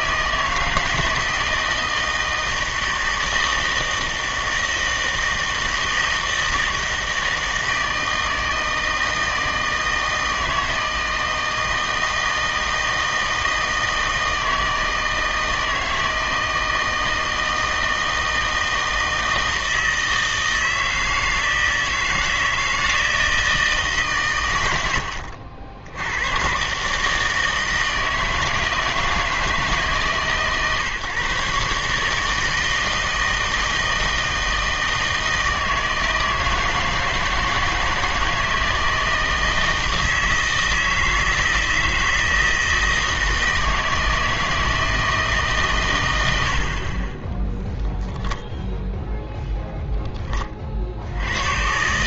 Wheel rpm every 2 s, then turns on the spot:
160, 160, 160, 160, 160, 160, 160, 160, 160, 160, 160, 160, 110, 130, 160, 140, 160, 160, 160, 160, 160, 160, 160, 70, 0, 50.
none